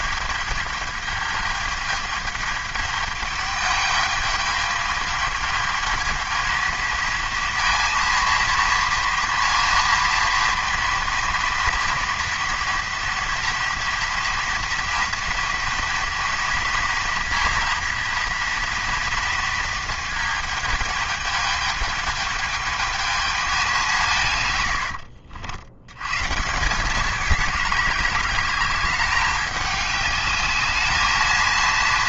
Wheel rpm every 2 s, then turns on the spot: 210, 210, 210, 220, 230, 230, 230, 230, 230, 230, 220, 220, 90, 190, 200, 210.
none